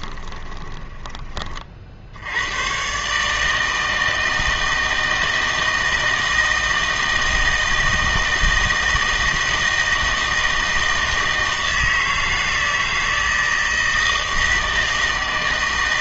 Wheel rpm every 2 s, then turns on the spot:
20, 120, 160, 160, 160, 160, 160, 160.
0-2